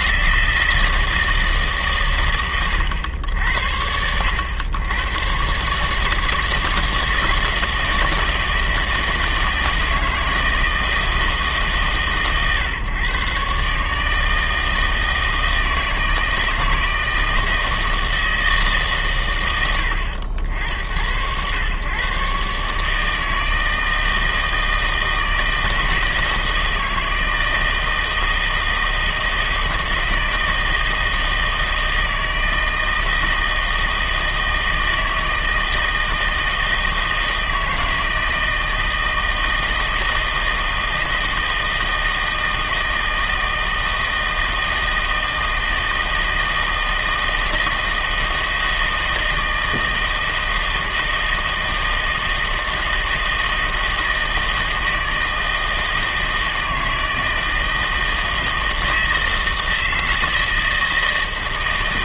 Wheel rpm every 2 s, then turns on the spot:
160, 120, 100, 160, 160, 160, 140, 160, 160, 160, 70, 140, 160, 160, 160, 160, 160, 160, 160, 160, 160, 160, 160, 160, 160, 160, 160, 160, 160, 160, 160.
none